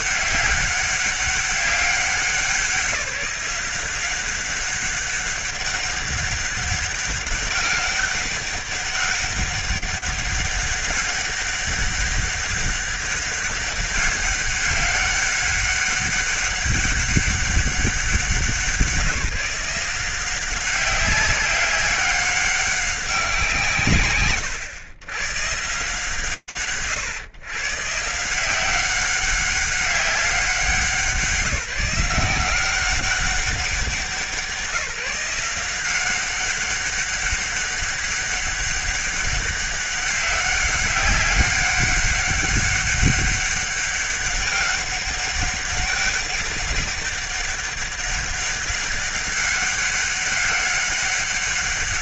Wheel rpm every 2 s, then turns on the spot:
200, 190, 190, 200, 200, 190, 200, 200, 200, 190, 190, 200, 110, 120, 170, 180, 180, 160, 190, 200, 190, 200, 200, 200, 200, 200.
none